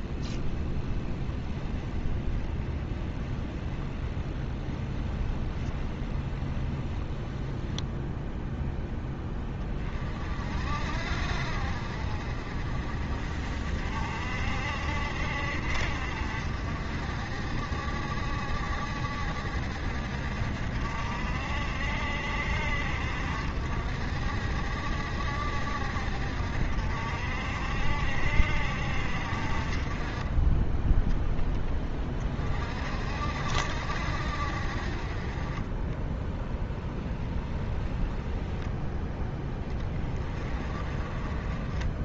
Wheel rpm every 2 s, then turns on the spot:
10, 10, 10, 10, 0, 50, 40, 50, 50, 50, 50, 60, 50, 60, 50, 10, 50, 40, 10, 0, 30.
0-8 36-38